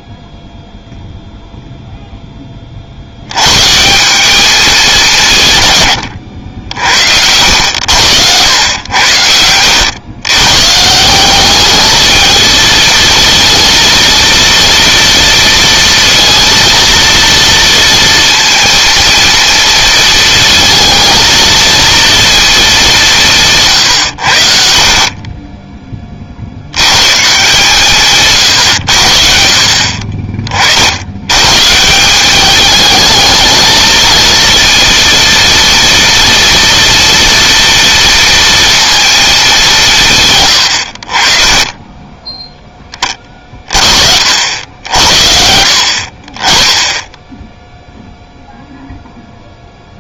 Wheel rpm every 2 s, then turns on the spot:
0, 50, 190, 70, 90, 160, 230, 230, 230, 230, 220, 200, 50, 120, 70, 80, 220, 230, 230, 230, 60, 20, 80, 10, 0.
40-42